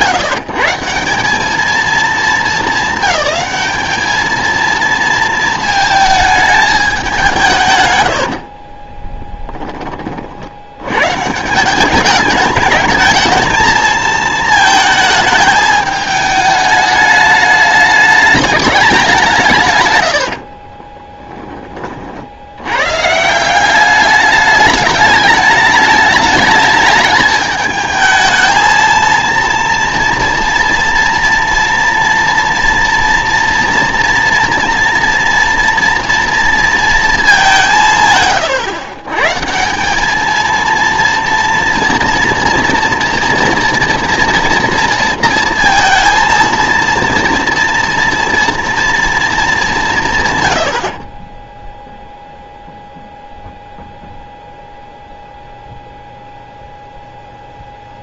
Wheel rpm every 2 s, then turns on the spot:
160, 200, 220, 210, 30, 90, 210, 220, 210, 200, 40, 100, 210, 210, 220, 230, 230, 240, 230, 130, 230, 230, 230, 230, 230, 100, 0, 0, 0.
8-10 20-22